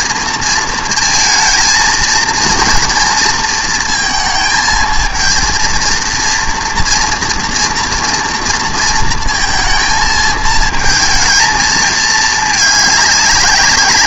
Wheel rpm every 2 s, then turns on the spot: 230, 230, 220, 240, 230, 220, 210.
none